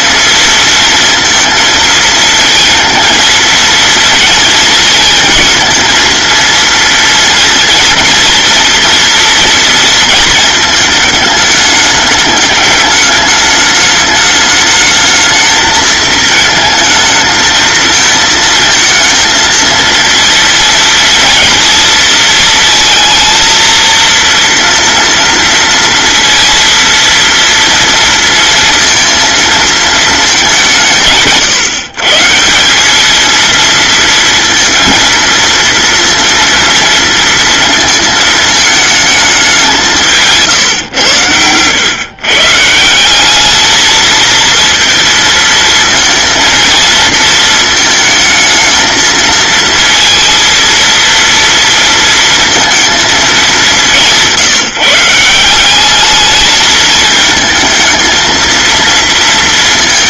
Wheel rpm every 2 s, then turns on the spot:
230, 230, 230, 230, 240, 220, 210, 210, 220, 220, 230, 230, 230, 230, 230, 170, 190, 230, 230, 220, 120, 170, 230, 230, 220, 230, 230, 160, 220, 230.
none